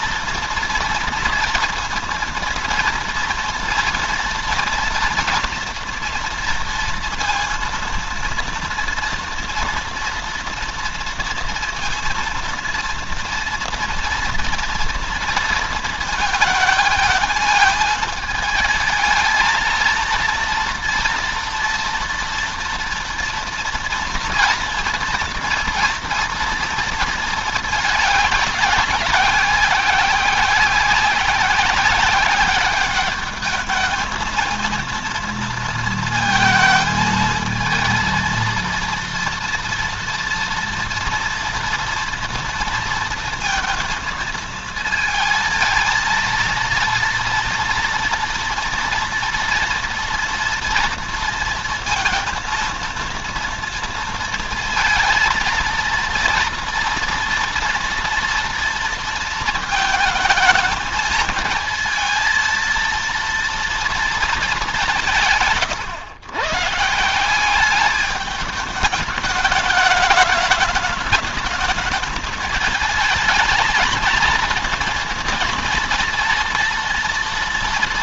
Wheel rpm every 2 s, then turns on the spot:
230, 230, 230, 230, 230, 230, 230, 230, 220, 220, 230, 230, 240, 230, 200, 190, 200, 220, 220, 230, 230, 230, 230, 230, 230, 230, 230, 230, 230, 230, 220, 230, 200, 140, 210, 210, 220, 220, 230.
none